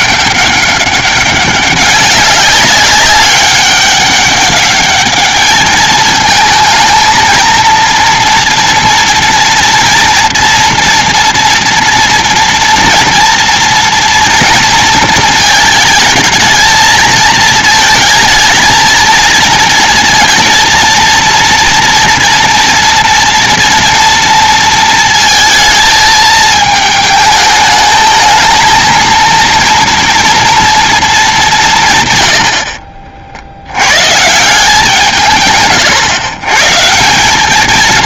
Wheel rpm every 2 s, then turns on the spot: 200, 200, 200, 220, 230, 230, 230, 240, 220, 220, 230, 230, 230, 220, 220, 230, 90, 160, 120.
none